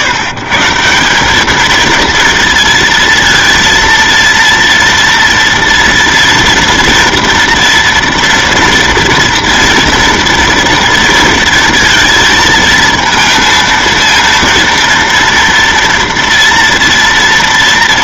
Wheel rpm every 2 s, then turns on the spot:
140, 230, 230, 230, 230, 230, 230, 230, 230.
none